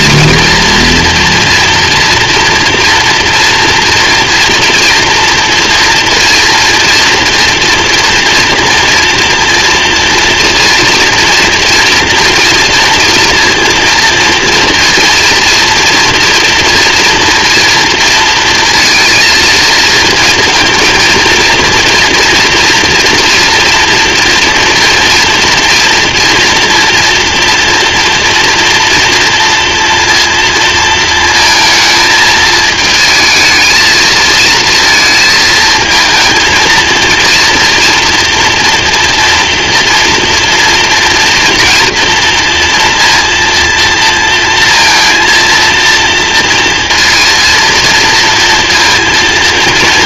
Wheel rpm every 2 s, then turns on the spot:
230, 230, 230, 230, 240, 230, 230, 230, 240, 230, 230, 230, 230, 230, 230, 230, 220, 230, 230, 230, 230, 230, 230, 230, 230.
none